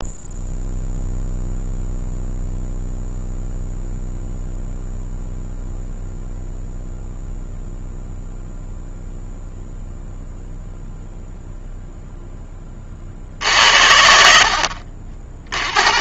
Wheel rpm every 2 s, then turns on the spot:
0, 0, 0, 0, 0, 0, 30, 50.
none